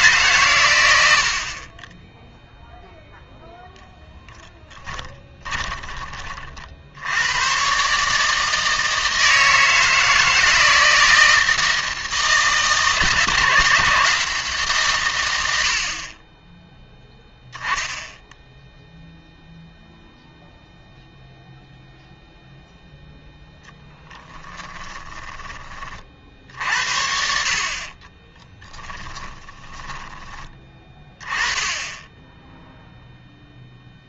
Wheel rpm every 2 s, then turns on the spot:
120, 0, 10, 60, 160, 160, 160, 150, 10, 0, 0, 0, 10, 60, 10, 20, 0.
4-6 24-26 28-30